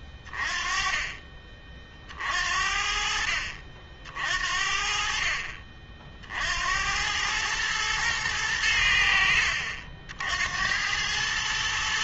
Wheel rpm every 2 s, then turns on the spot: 30, 60, 50, 90, 90, 100.
none